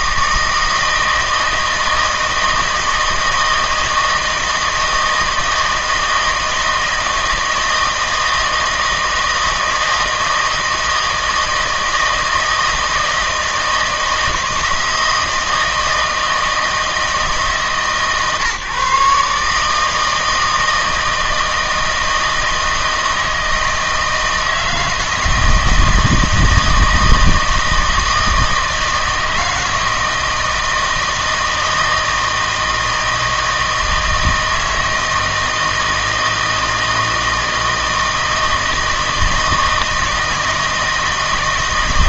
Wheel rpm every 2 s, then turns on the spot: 160, 160, 160, 160, 160, 160, 160, 160, 160, 140, 160, 160, 160, 160, 160, 160, 160, 160, 160, 160, 160.
none